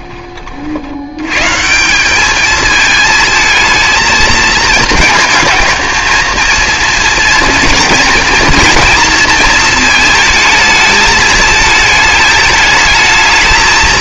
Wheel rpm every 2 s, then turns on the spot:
50, 220, 220, 230, 230, 220, 220.
none